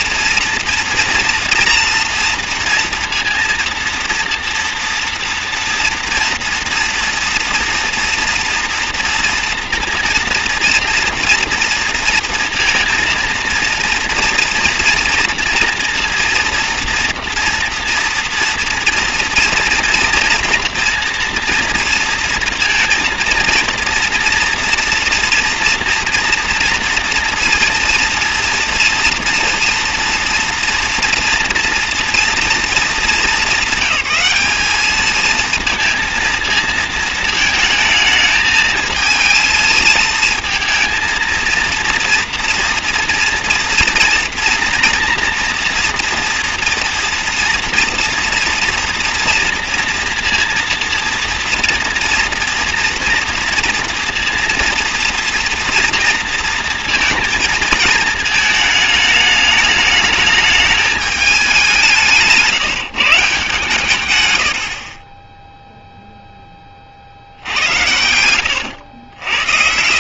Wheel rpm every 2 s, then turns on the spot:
230, 230, 230, 230, 230, 230, 230, 230, 230, 240, 230, 230, 230, 230, 230, 230, 220, 210, 220, 220, 230, 230, 230, 230, 230, 230, 230, 230, 230, 220, 210, 170, 60, 30, 90.
68-70